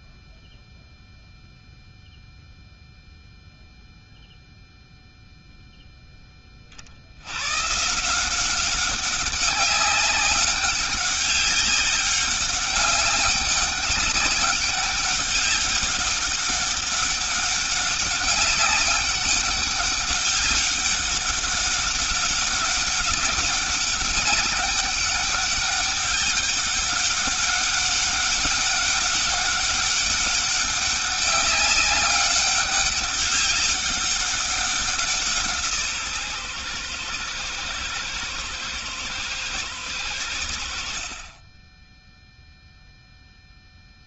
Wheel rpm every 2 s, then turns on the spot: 0, 0, 0, 40, 190, 190, 200, 200, 200, 200, 200, 200, 200, 200, 200, 200, 200, 180, 120, 110, 60, 0.
none